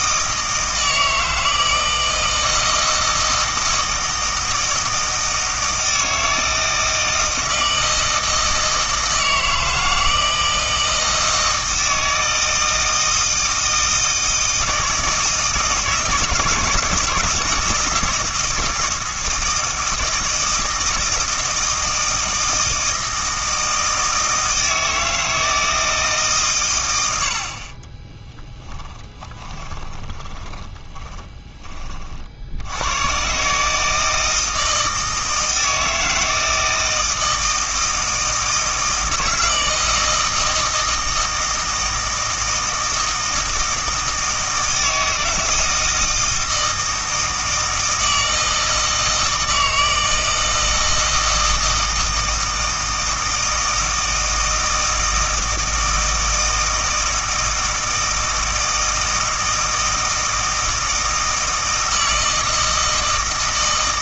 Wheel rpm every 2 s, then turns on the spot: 160, 160, 160, 160, 160, 160, 160, 160, 160, 160, 160, 160, 160, 140, 10, 20, 90, 160, 160, 160, 160, 160, 160, 160, 160, 160, 160, 160, 160, 160, 160, 160.
28-32